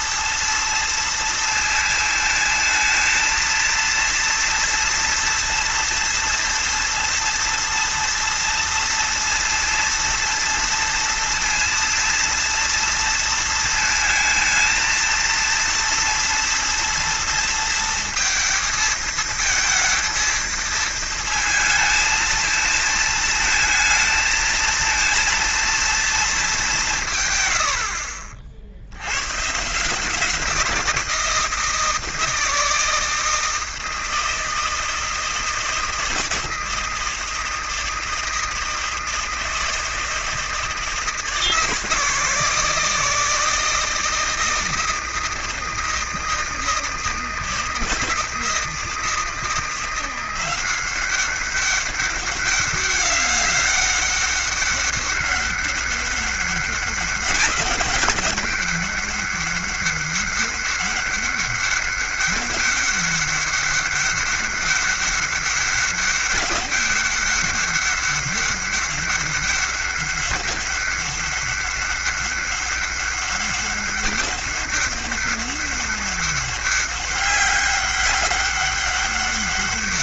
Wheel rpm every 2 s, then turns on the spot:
230, 220, 230, 230, 230, 230, 230, 230, 230, 230, 230, 230, 230, 200, 60, 170, 160, 160, 160, 160, 160, 160, 160, 160, 160, 180, 200, 200, 200, 200, 200, 200, 200, 200, 200, 200, 200, 200, 200, 200.
none